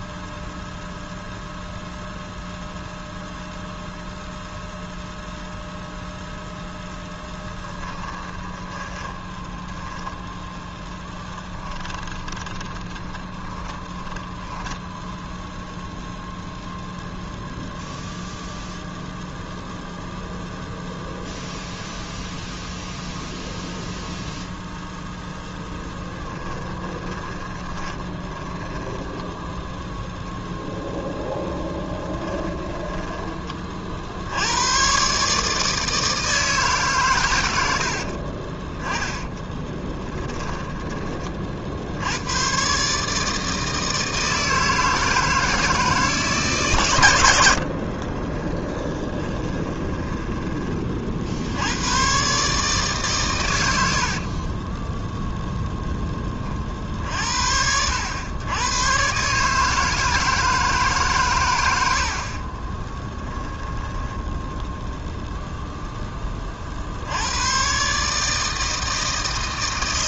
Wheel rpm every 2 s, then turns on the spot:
0, 0, 0, 0, 20, 10, 30, 10, 0, 0, 0, 0, 0, 20, 10, 0, 10, 110, 150, 20, 20, 140, 160, 140, 20, 30, 140, 20, 40, 110, 150, 20, 10, 40, 160.
8-10 12-16 26-30 32-34 40-42 48-50 54-56 62-64